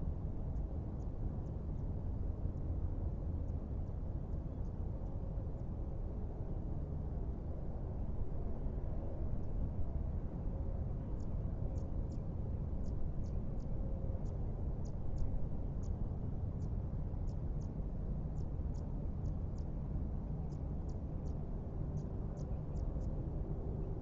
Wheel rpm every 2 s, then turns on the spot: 0, 0, 0, 0, 0, 0, 0, 0, 0, 0, 0, 0.
none